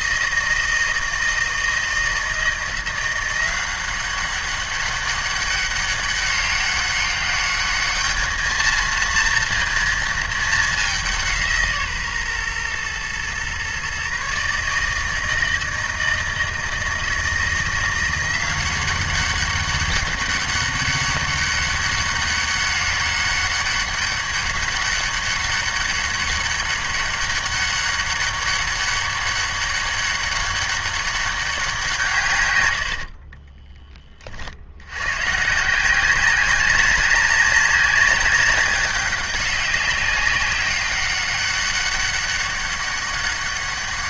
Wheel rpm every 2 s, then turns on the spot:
160, 170, 190, 200, 220, 210, 120, 150, 160, 180, 200, 200, 200, 200, 200, 200, 110, 70, 190, 190, 200, 200.
none